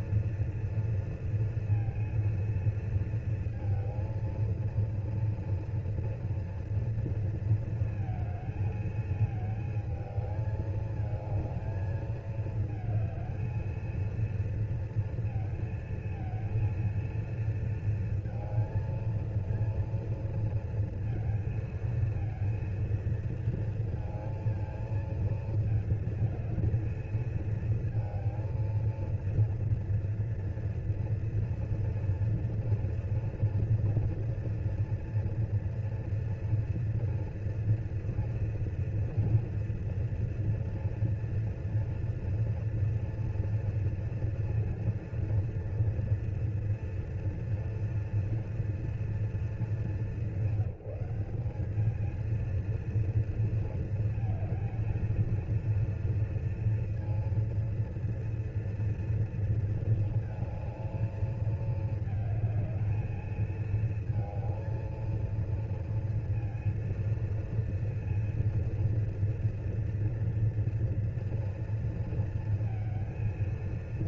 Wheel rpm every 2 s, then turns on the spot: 240, 230, 230, 230, 220, 220, 220, 230, 230, 230, 230, 230, 220, 220, 230, 230, 230, 240, 240, 240, 230, 240, 230, 230, 230, 190, 230, 230, 230, 230, 220, 220, 230, 230, 230, 230, 230.
none